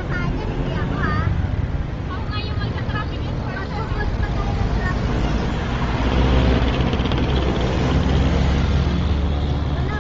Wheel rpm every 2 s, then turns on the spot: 0, 0, 0, 0, 0.
none